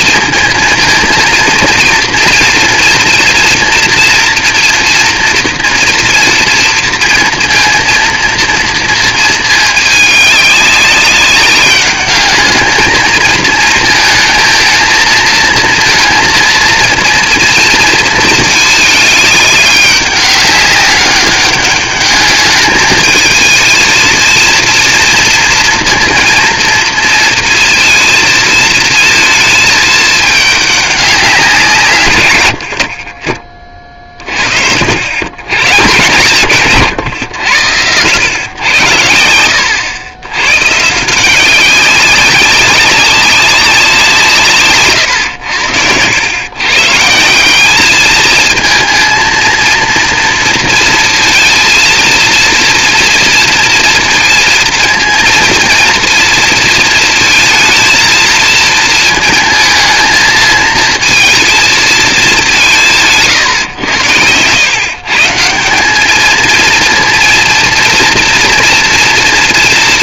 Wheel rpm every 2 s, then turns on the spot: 230, 230, 230, 230, 230, 200, 210, 220, 230, 220, 200, 210, 230, 230, 220, 210, 90, 50, 130, 100, 130, 190, 150, 120, 220, 230, 230, 230, 230, 220, 220, 190, 120, 230, 230.
none